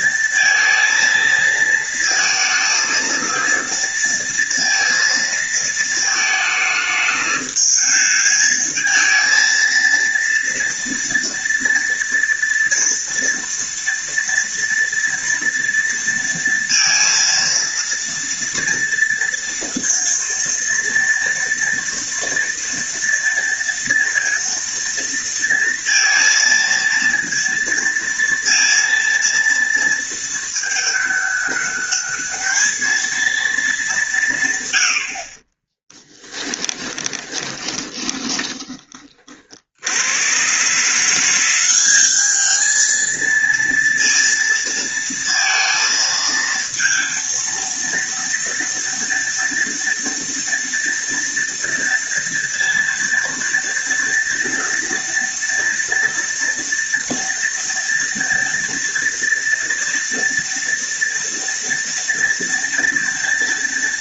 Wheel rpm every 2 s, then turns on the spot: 220, 230, 230, 220, 220, 230, 230, 230, 230, 230, 230, 230, 230, 230, 230, 210, 220, 90, 20, 20, 140, 220, 230, 230, 230, 230, 230, 230, 230, 230, 230, 230.
36-38